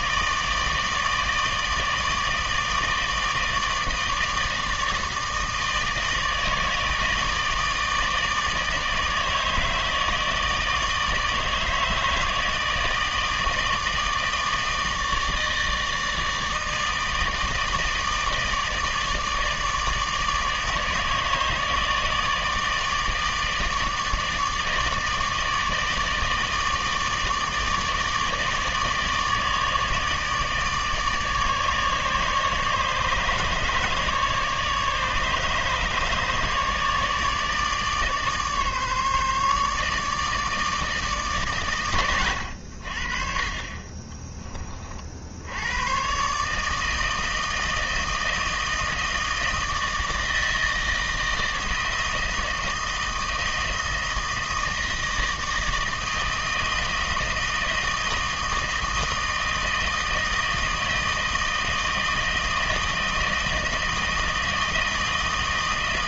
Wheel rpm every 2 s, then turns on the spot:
160, 160, 160, 160, 150, 150, 160, 160, 160, 160, 150, 160, 150, 160, 160, 150, 150, 150, 150, 150, 160, 70, 40, 150, 160, 160, 160, 160, 160, 160, 160, 160, 160.
none